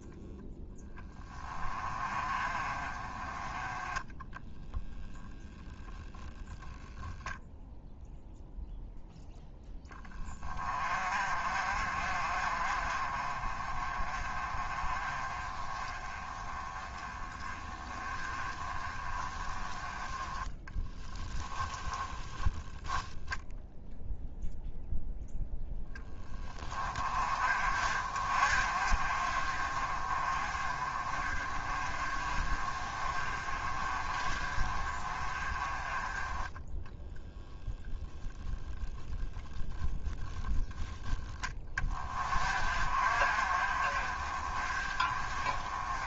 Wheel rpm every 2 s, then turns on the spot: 20, 30, 0, 0, 0, 30, 40, 30, 20, 20, 10, 0, 0, 30, 40, 30, 30, 30, 0, 10, 10, 40, 30.
20-22